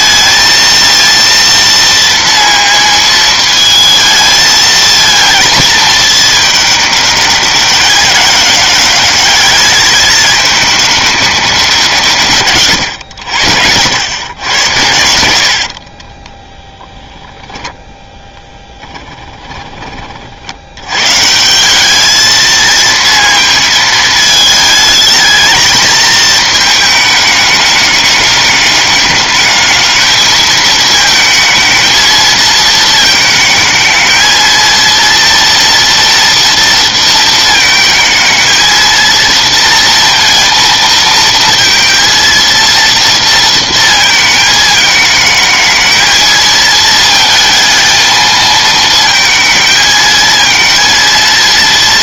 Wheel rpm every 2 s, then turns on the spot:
230, 230, 220, 210, 210, 210, 100, 80, 0, 10, 80, 230, 220, 220, 200, 220, 230, 230, 230, 230, 230, 230, 220, 220, 220, 230.
18-20